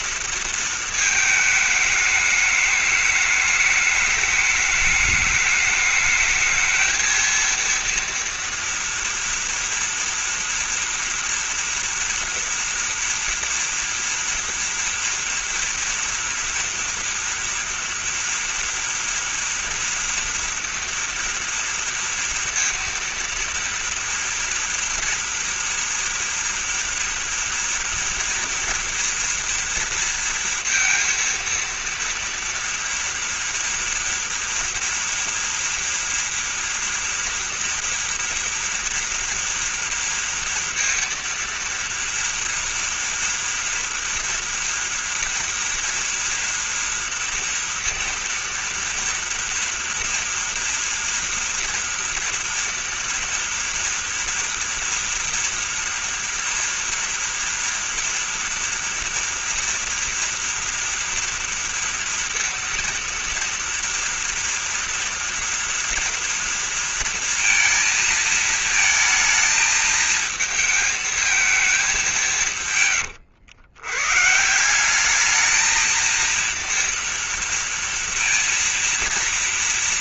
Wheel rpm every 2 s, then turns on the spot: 220, 210, 210, 220, 230, 230, 240, 230, 230, 230, 230, 230, 230, 230, 240, 230, 230, 230, 240, 230, 230, 230, 240, 230, 230, 230, 230, 230, 230, 230, 230, 230, 230, 230, 230, 220, 130, 190, 230, 230.
none